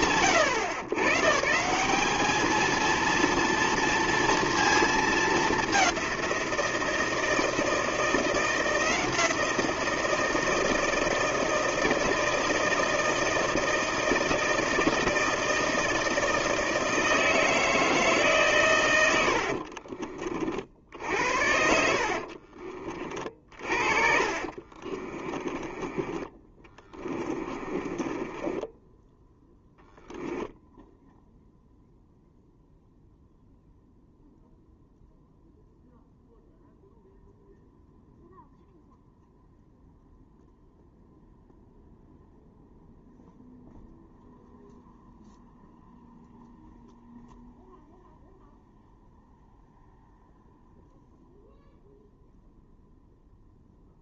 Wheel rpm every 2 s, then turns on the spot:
130, 230, 220, 160, 170, 160, 160, 160, 160, 100, 60, 30, 30, 20, 10, 0, 0, 0, 0, 0, 0, 0, 0, 0, 0, 0, 0.
24-30